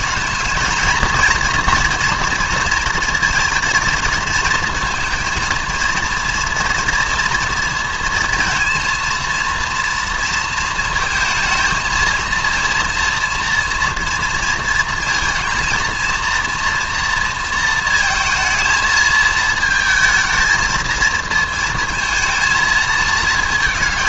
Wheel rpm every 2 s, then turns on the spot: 220, 230, 230, 230, 230, 230, 230, 230, 230, 220, 220, 220.
none